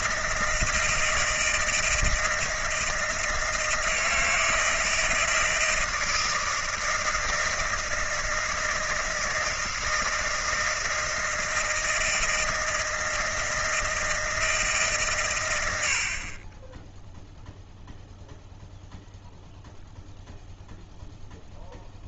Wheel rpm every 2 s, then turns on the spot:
160, 160, 160, 160, 160, 160, 160, 140, 10, 0, 0.
none